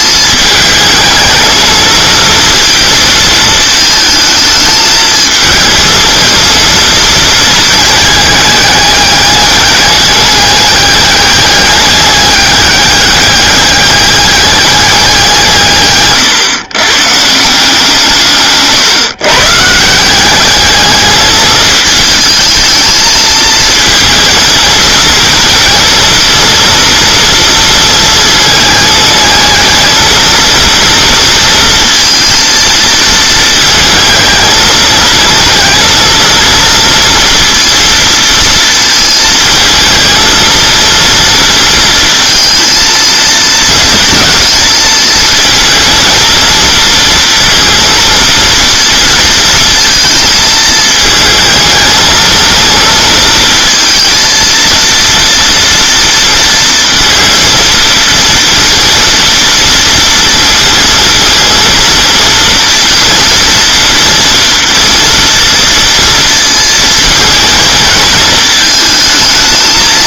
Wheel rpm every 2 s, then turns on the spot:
220, 230, 220, 230, 210, 210, 200, 200, 130, 140, 210, 220, 230, 240, 220, 230, 230, 220, 230, 230, 230, 230, 220, 230, 230, 220, 230, 230, 230, 230, 230, 230, 230, 230, 220.
18-20